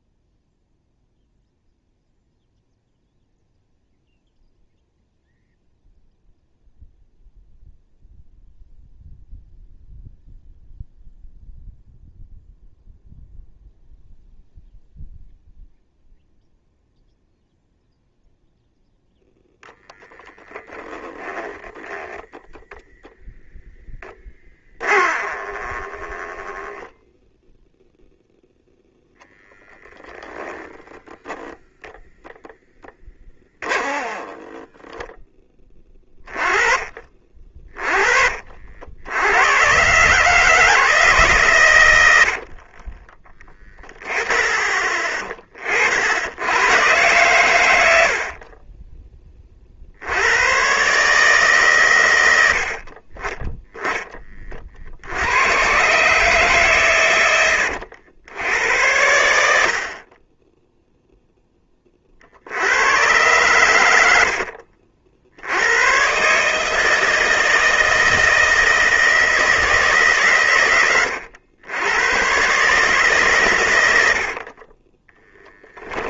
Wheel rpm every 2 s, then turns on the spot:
0, 0, 0, 0, 0, 0, 0, 0, 0, 0, 10, 0, 20, 10, 0, 10, 10, 10, 30, 70, 150, 40, 20, 120, 20, 130, 50, 50, 130, 80, 0, 110, 70, 160, 160, 100, 140, 20.
20-22 24-26 32-36 42-44 74-76